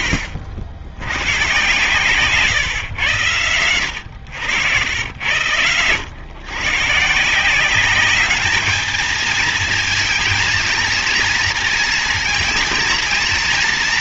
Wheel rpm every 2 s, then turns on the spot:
80, 130, 100, 120, 210, 230, 230.
none